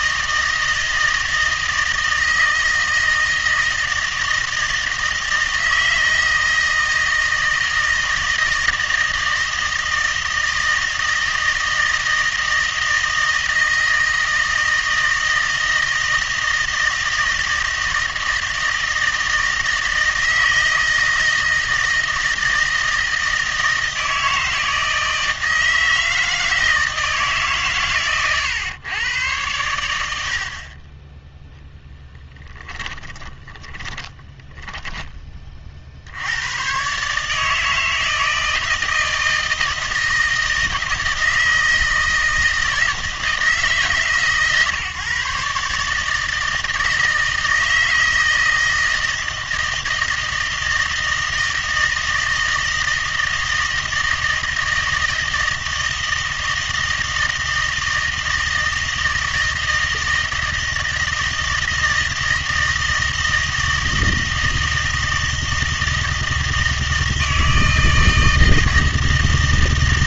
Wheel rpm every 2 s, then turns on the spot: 160, 160, 160, 160, 160, 160, 160, 160, 160, 160, 160, 160, 160, 160, 110, 40, 10, 10, 120, 160, 160, 160, 140, 160, 160, 160, 160, 160, 160, 160, 160, 160, 160, 160, 160.
32-36